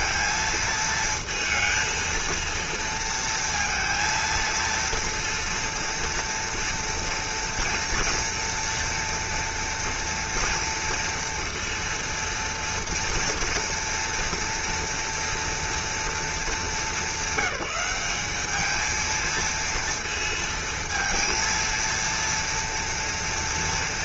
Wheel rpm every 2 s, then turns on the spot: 230, 230, 230, 230, 230, 230, 230, 230, 200, 220, 220, 230.
none